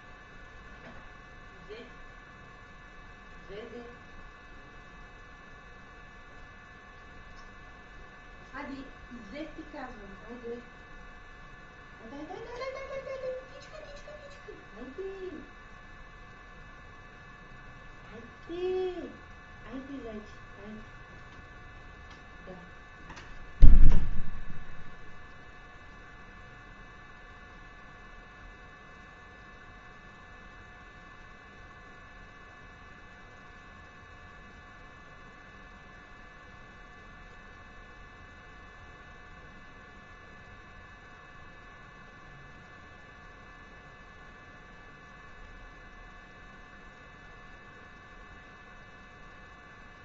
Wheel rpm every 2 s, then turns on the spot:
0, 0, 0, 0, 0, 0, 0, 0, 0, 0, 0, 0, 0, 0, 0, 0, 0, 0, 0, 0, 0, 0, 0, 0, 0.
none